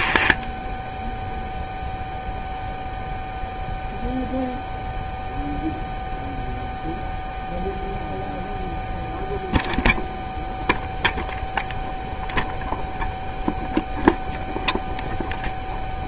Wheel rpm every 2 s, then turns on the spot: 0, 0, 0, 0, 0, 0, 0, 0.
none